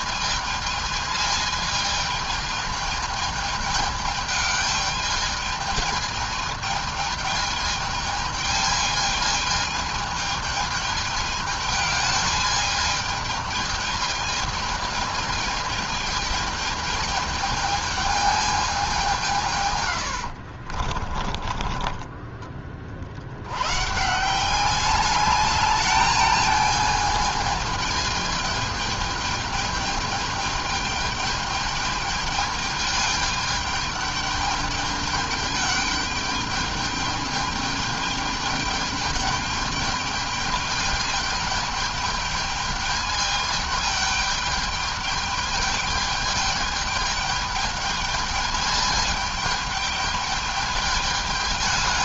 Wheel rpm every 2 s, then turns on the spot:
220, 220, 210, 220, 220, 220, 220, 220, 220, 190, 50, 50, 200, 220, 210, 210, 210, 210, 210, 210, 210, 210, 210, 210, 210, 210.
20-22